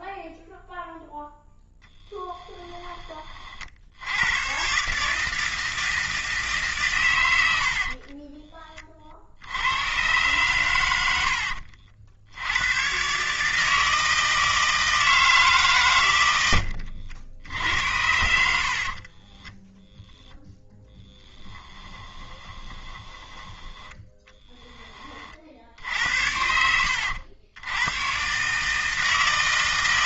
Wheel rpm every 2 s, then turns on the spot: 0, 10, 130, 150, 20, 110, 100, 160, 80, 60, 10, 20, 10, 80, 150.
18-20 22-24